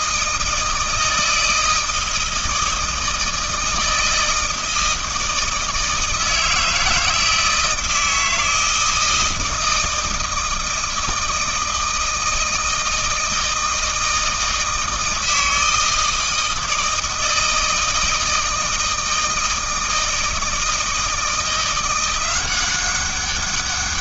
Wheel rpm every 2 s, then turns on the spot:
160, 160, 160, 160, 160, 160, 160, 160, 160, 160, 160, 190.
none